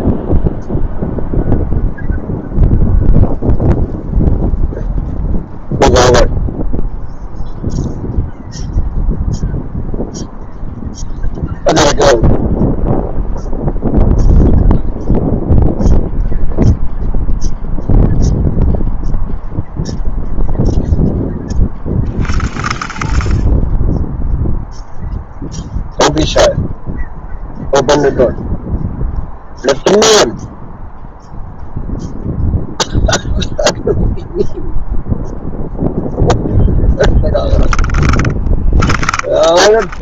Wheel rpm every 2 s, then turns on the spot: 0, 0, 0, 0, 0, 0, 0, 0, 0, 0, 10, 40, 0, 0, 0, 0, 0, 0, 0, 10.
38-40